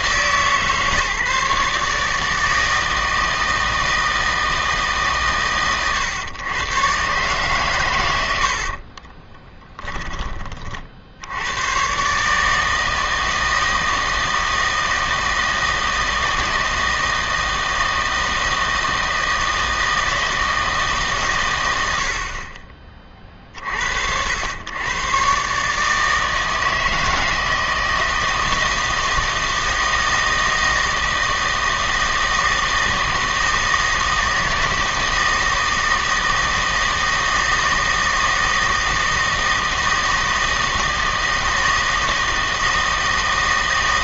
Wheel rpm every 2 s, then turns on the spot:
140, 160, 150, 120, 50, 50, 160, 160, 160, 160, 160, 30, 100, 160, 160, 160, 160, 160, 160, 160, 160, 160.
8-10